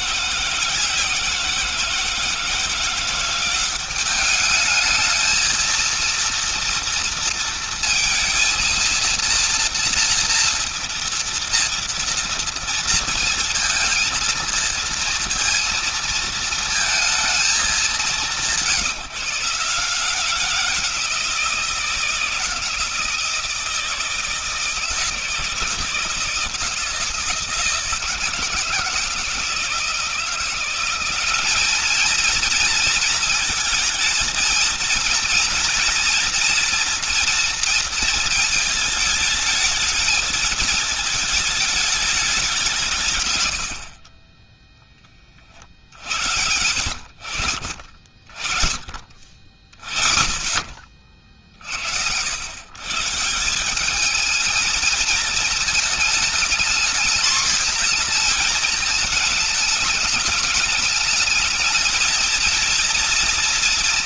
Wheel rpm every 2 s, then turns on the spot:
170, 170, 210, 230, 230, 230, 230, 230, 230, 180, 180, 160, 160, 160, 170, 180, 230, 230, 240, 220, 220, 190, 20, 70, 40, 40, 110, 220, 220, 230, 210, 230.
none